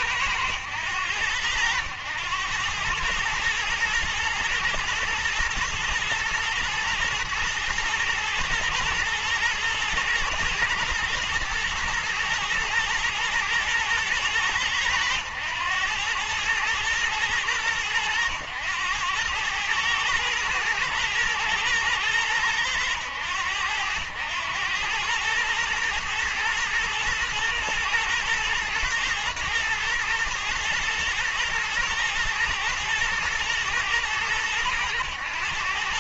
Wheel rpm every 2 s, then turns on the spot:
100, 110, 110, 120, 110, 120, 120, 100, 110, 100, 110, 100, 100, 120, 120, 110, 110, 110.
none